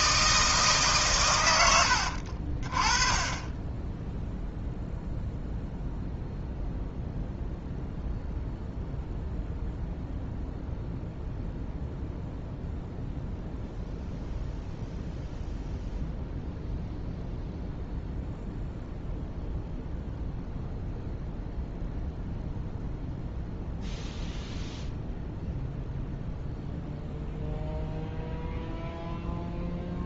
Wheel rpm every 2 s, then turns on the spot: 150, 40, 0, 0, 0, 0, 0, 0, 0, 0, 0, 0, 0, 0, 0.
none